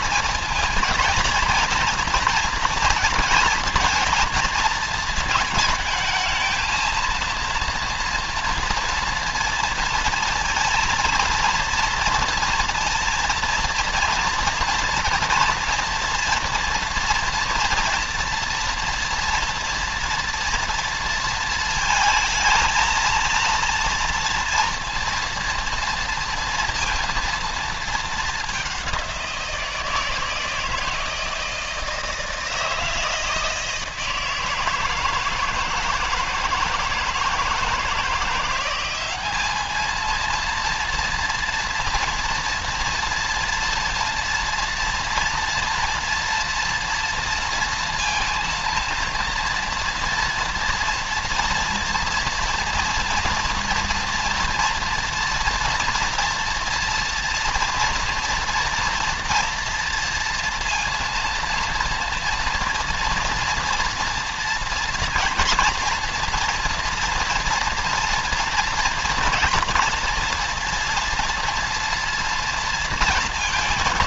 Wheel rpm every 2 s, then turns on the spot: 220, 230, 220, 220, 230, 230, 230, 230, 240, 230, 230, 230, 230, 230, 200, 160, 160, 160, 160, 180, 230, 240, 230, 230, 230, 230, 230, 230, 230, 230, 230, 240, 230, 230, 230, 230, 230.
none